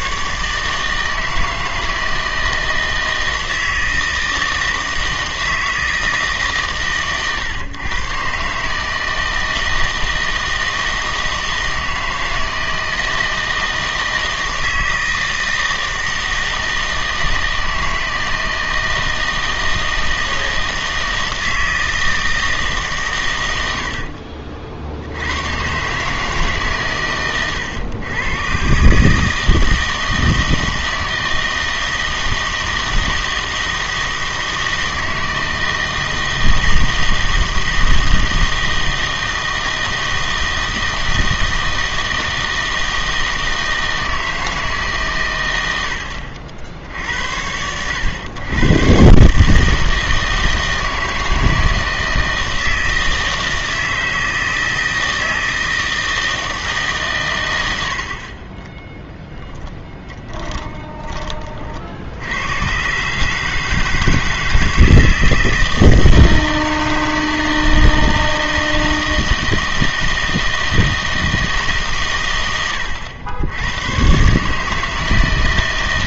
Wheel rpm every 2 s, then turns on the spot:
150, 160, 160, 130, 140, 160, 160, 160, 160, 160, 160, 150, 60, 130, 130, 160, 160, 160, 160, 160, 160, 160, 150, 70, 110, 160, 160, 160, 150, 20, 20, 110, 160, 160, 160, 160, 100, 150.
none